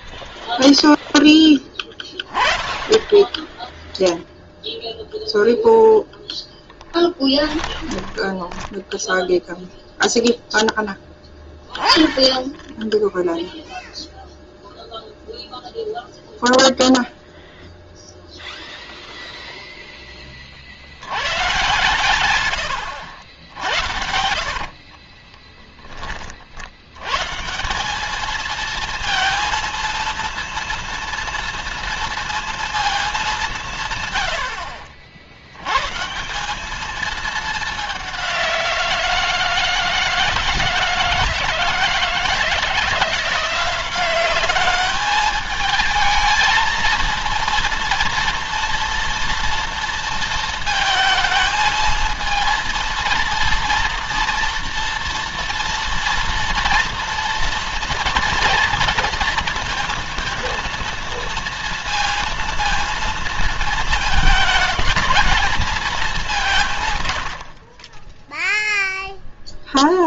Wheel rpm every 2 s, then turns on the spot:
0, 30, 0, 10, 10, 0, 10, 0, 0, 0, 40, 110, 70, 70, 220, 230, 230, 70, 190, 180, 160, 160, 200, 220, 230, 220, 230, 230, 230, 230, 230, 230, 220, 170, 0.
8-10 24-26